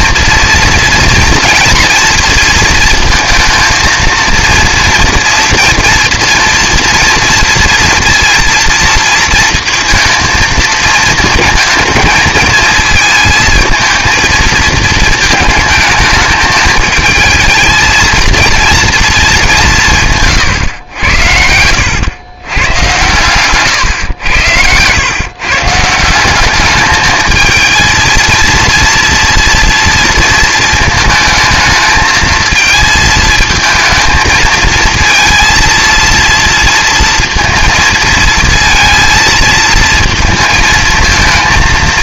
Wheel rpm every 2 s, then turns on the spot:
230, 230, 230, 230, 230, 220, 220, 220, 220, 230, 120, 120, 110, 210, 230, 230, 220, 230, 230, 230, 230.
none